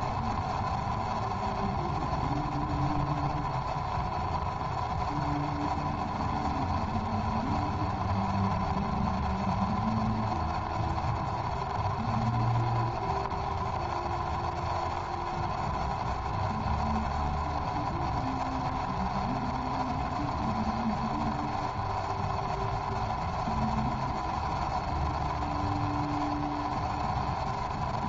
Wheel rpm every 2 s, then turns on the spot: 0, 0, 0, 0, 0, 0, 0, 0, 0, 0, 0, 0, 0, 0.
none